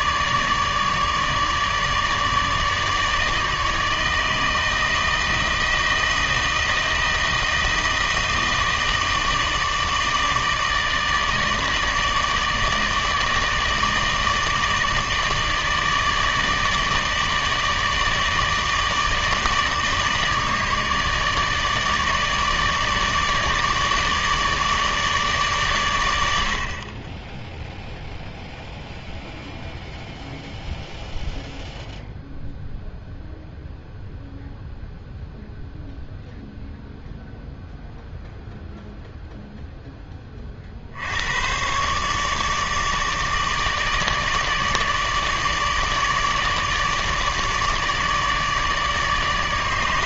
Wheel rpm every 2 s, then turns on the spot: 150, 150, 160, 160, 160, 160, 150, 150, 150, 150, 150, 150, 150, 60, 0, 0, 0, 0, 0, 0, 50, 150, 150, 150, 150.
none